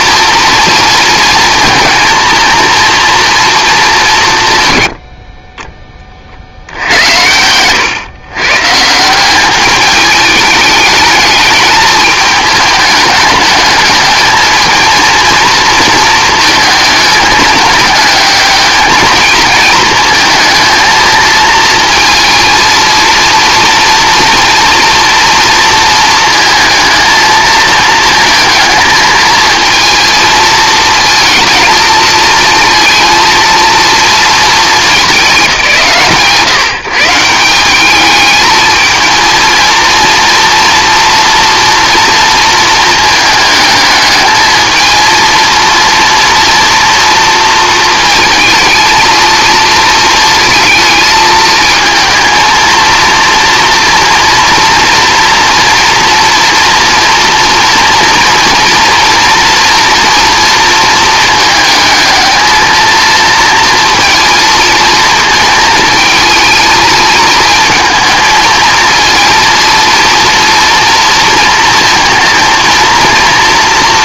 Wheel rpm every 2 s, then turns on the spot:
230, 230, 80, 80, 160, 210, 210, 230, 210, 220, 220, 230, 240, 230, 230, 230, 230, 210, 150, 220, 230, 220, 220, 230, 230, 220, 230, 230, 230, 230, 230, 220, 230, 220, 230, 230, 230.
none